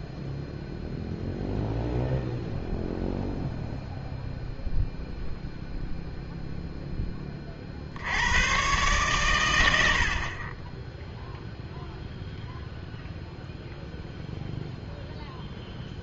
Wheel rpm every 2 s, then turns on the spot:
0, 0, 0, 0, 120, 10, 0, 0.
none